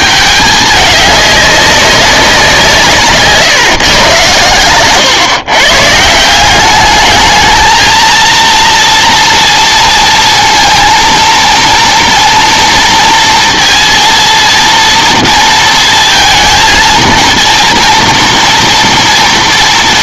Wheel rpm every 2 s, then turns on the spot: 210, 160, 120, 200, 230, 230, 230, 230, 230, 230.
none